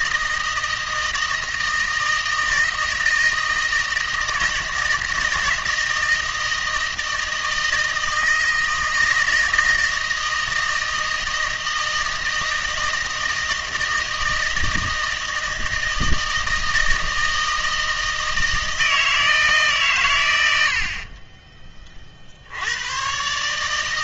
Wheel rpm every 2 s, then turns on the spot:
160, 160, 170, 160, 160, 160, 160, 160, 160, 160, 70, 100.
none